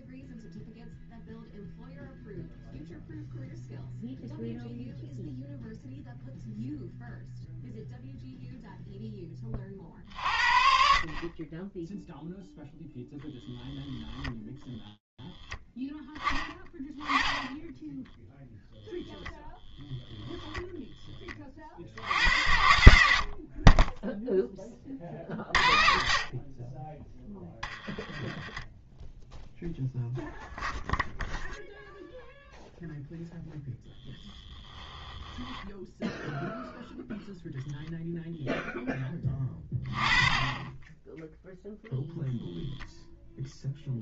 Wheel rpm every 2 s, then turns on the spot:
0, 0, 0, 0, 0, 50, 0, 10, 10, 0, 10, 80, 40, 20, 10, 0, 0, 10, 0, 10, 20, 0.
26-28